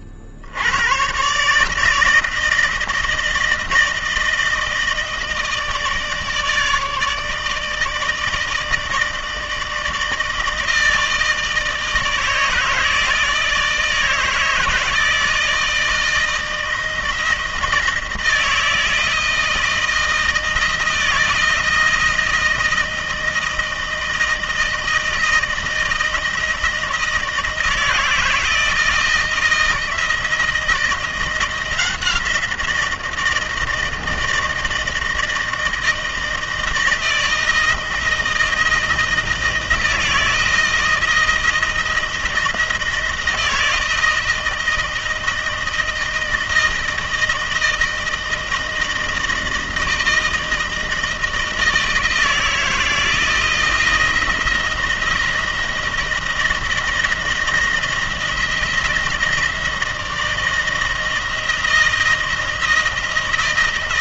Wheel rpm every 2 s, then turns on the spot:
70, 160, 160, 150, 160, 160, 160, 160, 160, 160, 160, 160, 160, 160, 160, 170, 170, 160, 160, 170, 170, 170, 160, 160, 160, 160, 160, 170, 170, 160, 160, 160.
none